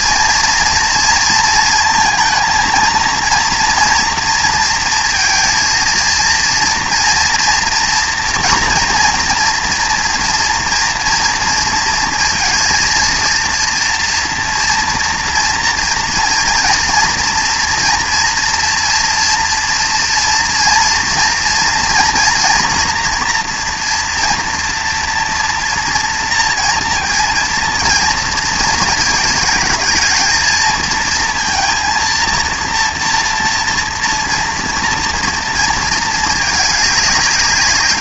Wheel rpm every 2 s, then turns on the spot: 230, 230, 230, 240, 230, 230, 230, 230, 230, 230, 230, 230, 230, 230, 230, 230, 230, 230, 210.
none